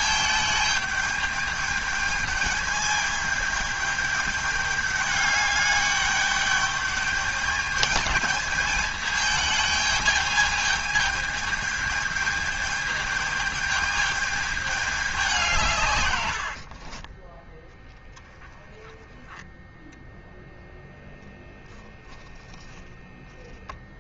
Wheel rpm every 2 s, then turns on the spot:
210, 210, 210, 210, 210, 210, 210, 210, 80, 20, 0, 0.
16-18